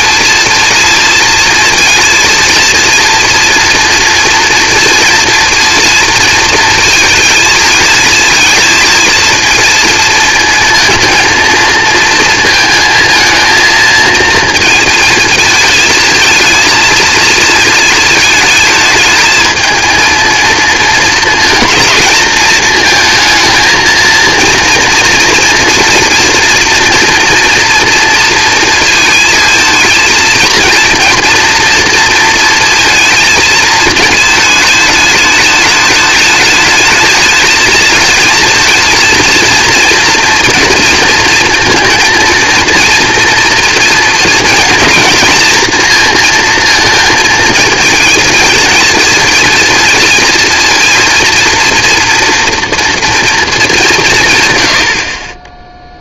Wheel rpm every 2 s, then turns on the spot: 230, 230, 230, 220, 230, 230, 230, 220, 230, 220, 230, 230, 230, 230, 230, 230, 230, 210, 220, 230, 230, 230, 230, 230, 230, 230, 230, 50.
none